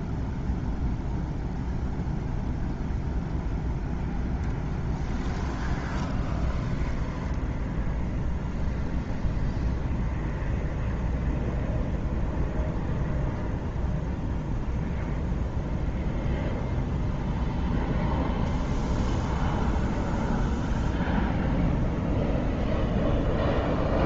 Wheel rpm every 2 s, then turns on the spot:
0, 0, 10, 10, 0, 0, 0, 0, 0, 0, 0, 0.
4-8